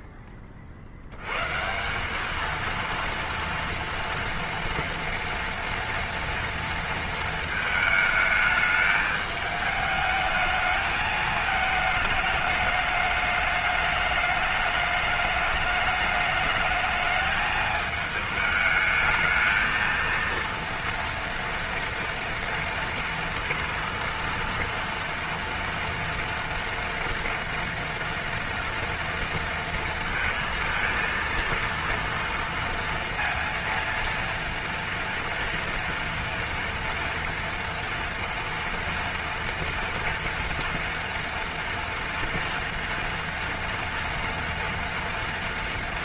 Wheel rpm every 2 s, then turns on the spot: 50, 220, 240, 230, 210, 220, 210, 210, 210, 220, 230, 230, 230, 230, 230, 230, 230, 230, 230, 230, 230, 230, 230.
none